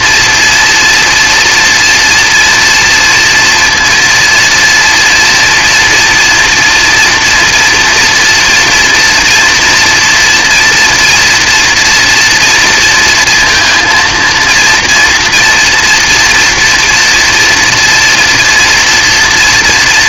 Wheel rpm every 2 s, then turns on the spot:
230, 240, 230, 230, 240, 230, 230, 230, 230, 240.
none